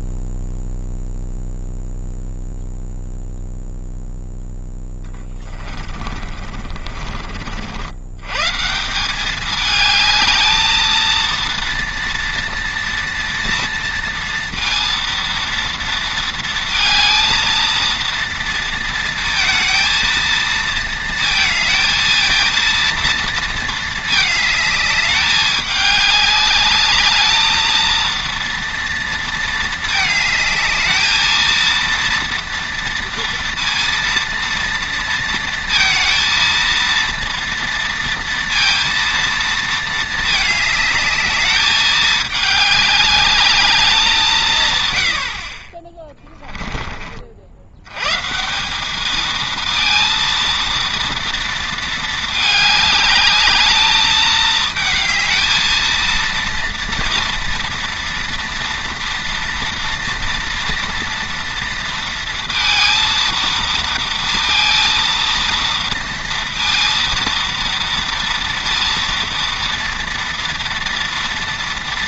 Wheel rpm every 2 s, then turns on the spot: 0, 0, 20, 50, 200, 230, 230, 230, 230, 230, 220, 230, 210, 210, 230, 220, 230, 230, 230, 230, 210, 210, 70, 50, 220, 230, 210, 220, 230, 230, 230, 230, 230, 230, 230, 230.
4-6